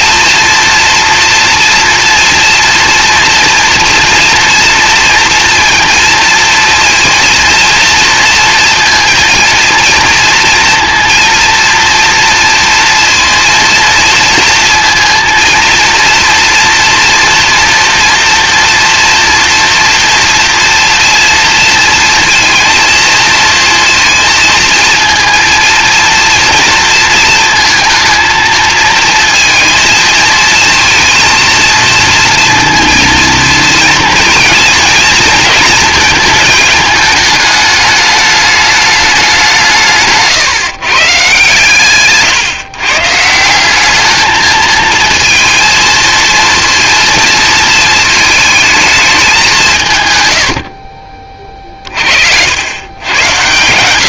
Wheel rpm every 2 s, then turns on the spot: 230, 230, 230, 230, 230, 230, 230, 230, 230, 230, 230, 230, 230, 230, 220, 230, 230, 230, 220, 210, 130, 130, 220, 230, 220, 50, 100.
none